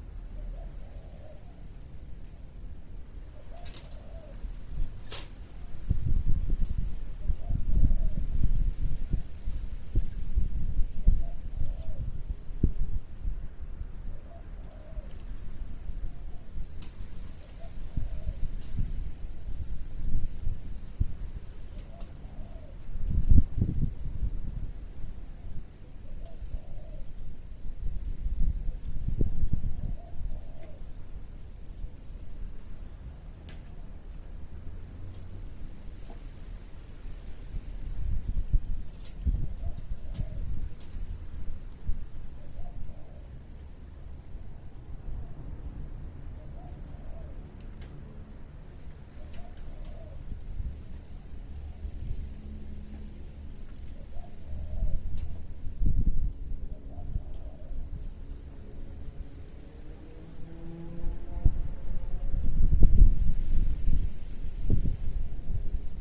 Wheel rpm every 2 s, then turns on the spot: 0, 0, 0, 0, 0, 0, 0, 0, 0, 0, 0, 0, 0, 0, 0, 0, 0, 0, 0, 0, 0, 0, 0, 0, 0, 0, 0, 0, 0, 0, 0, 0, 0.
none